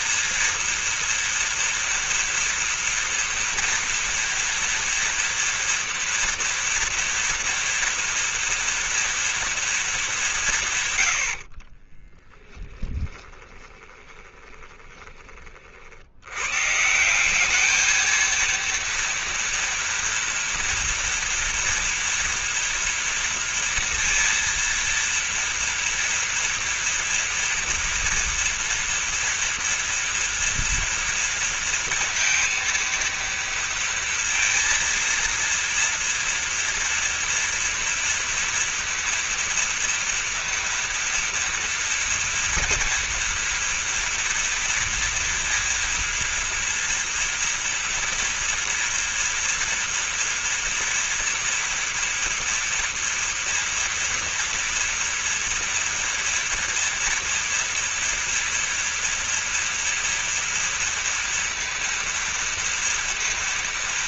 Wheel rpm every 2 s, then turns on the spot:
240, 230, 230, 230, 230, 140, 10, 20, 140, 230, 230, 230, 230, 230, 230, 230, 230, 230, 230, 230, 230, 230, 230, 230, 230, 230, 230, 230, 230, 230, 230, 230.
12-16